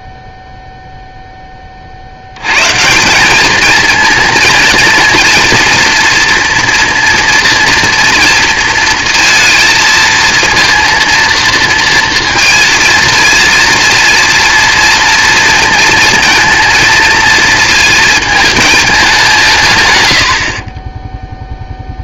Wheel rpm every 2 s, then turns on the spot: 0, 120, 230, 230, 230, 230, 230, 230, 230, 220, 50.
none